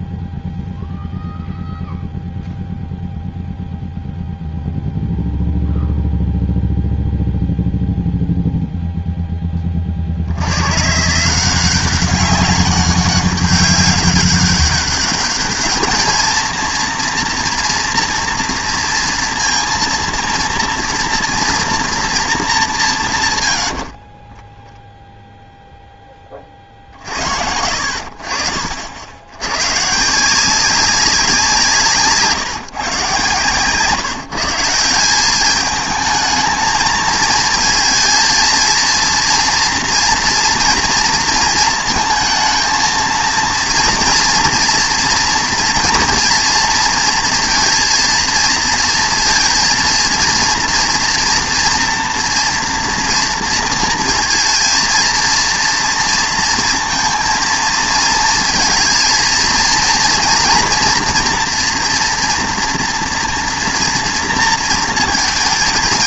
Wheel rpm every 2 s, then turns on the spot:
0, 0, 0, 0, 0, 140, 200, 200, 230, 230, 230, 180, 0, 40, 70, 180, 160, 160, 220, 230, 230, 220, 230, 230, 230, 230, 230, 230, 230, 230, 230, 230, 230.
none